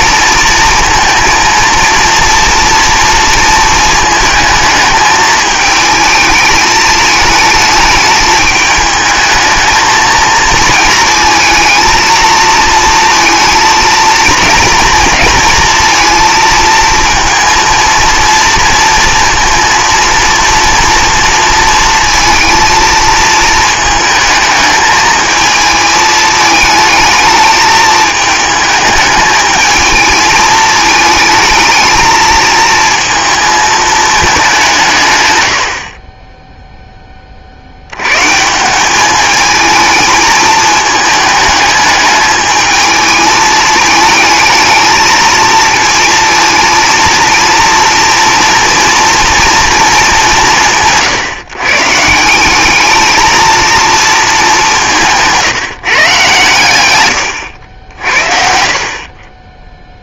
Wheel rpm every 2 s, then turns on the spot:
230, 230, 220, 220, 210, 220, 230, 230, 230, 230, 230, 230, 220, 220, 210, 220, 230, 170, 10, 180, 220, 220, 220, 230, 230, 170, 210, 190, 110, 60.
none